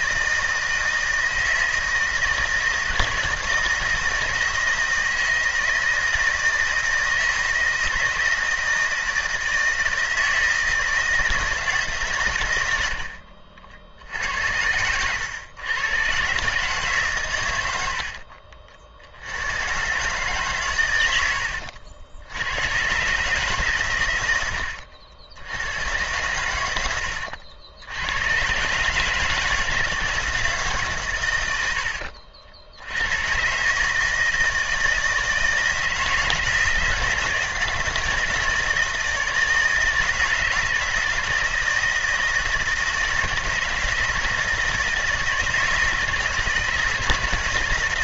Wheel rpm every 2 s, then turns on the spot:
160, 160, 160, 160, 160, 160, 70, 100, 130, 60, 120, 120, 80, 90, 150, 140, 80, 160, 160, 160, 160, 160, 160, 160.
12-14